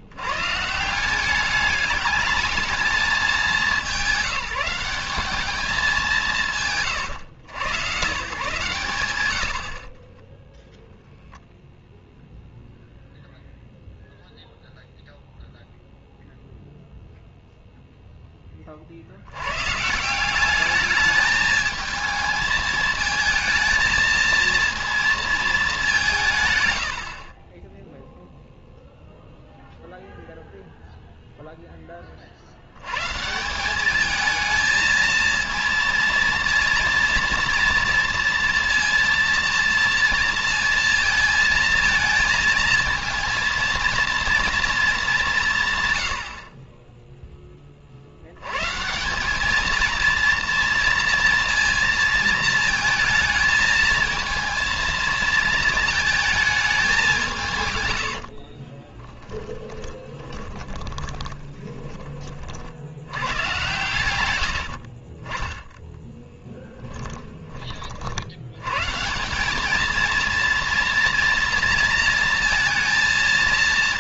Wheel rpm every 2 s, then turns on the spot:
210, 210, 200, 100, 90, 0, 0, 0, 0, 60, 210, 220, 220, 50, 0, 0, 100, 220, 230, 230, 230, 230, 220, 20, 100, 230, 220, 230, 210, 50, 20, 50, 80, 10, 90, 230, 230.
58-62 66-68